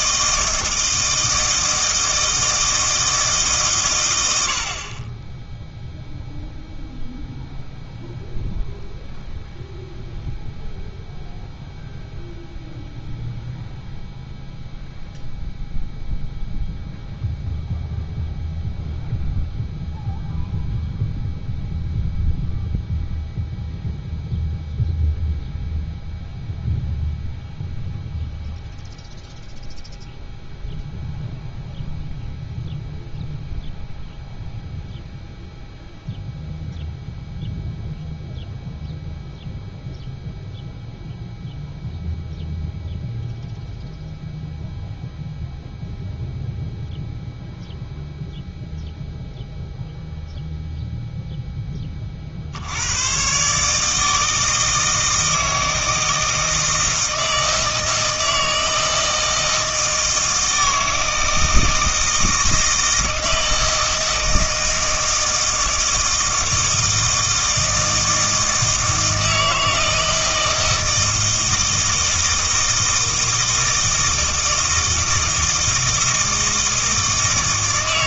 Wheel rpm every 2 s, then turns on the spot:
160, 160, 50, 0, 0, 0, 0, 0, 0, 0, 0, 0, 0, 0, 0, 0, 0, 0, 0, 0, 0, 0, 0, 0, 0, 0, 90, 160, 160, 160, 160, 160, 160, 160, 160, 160, 160, 160, 160.
none